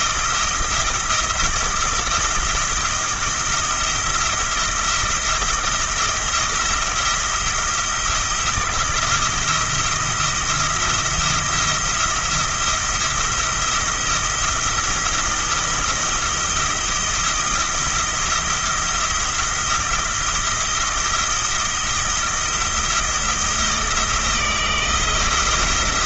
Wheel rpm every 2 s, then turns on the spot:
170, 170, 170, 170, 170, 170, 170, 170, 170, 170, 170, 170, 160.
none